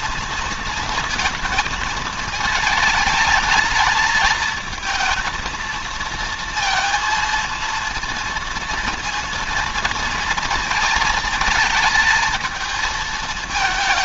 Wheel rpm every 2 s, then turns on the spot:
230, 220, 220, 230, 230, 220, 220.
none